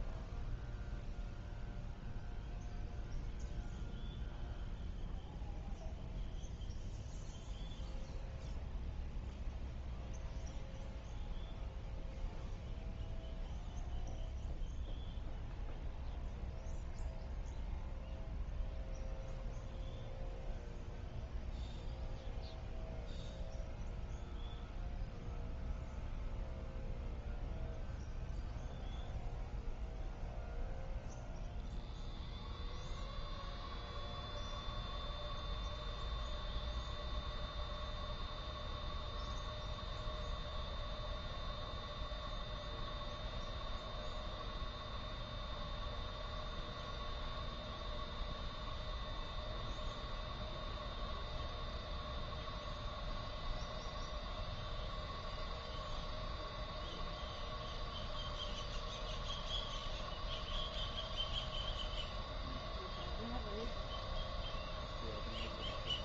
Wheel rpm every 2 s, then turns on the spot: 0, 0, 0, 0, 0, 0, 0, 0, 0, 0, 0, 0, 0, 0, 0, 0, 0, 0, 0, 0, 0, 0, 0, 0, 0, 0, 0, 0, 0, 0, 0, 0, 0.
none